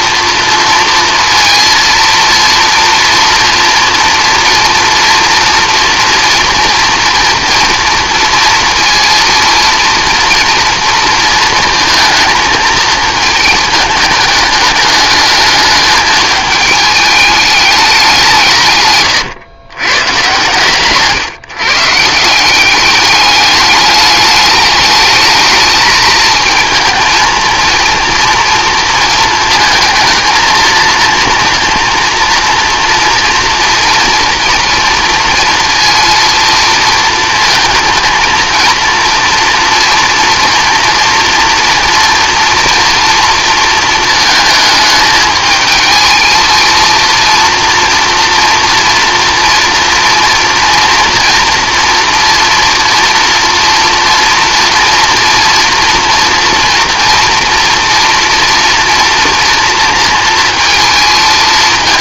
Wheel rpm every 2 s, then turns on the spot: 230, 230, 240, 240, 230, 230, 220, 210, 210, 130, 130, 190, 210, 220, 230, 230, 230, 230, 230, 230, 230, 230, 220, 230, 230, 230, 230, 240, 230, 230, 230.
18-22